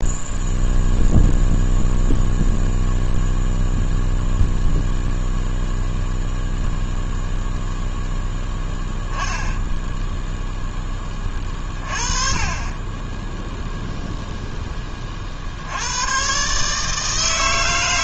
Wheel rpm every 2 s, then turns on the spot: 0, 0, 0, 0, 0, 10, 20, 10, 150.
none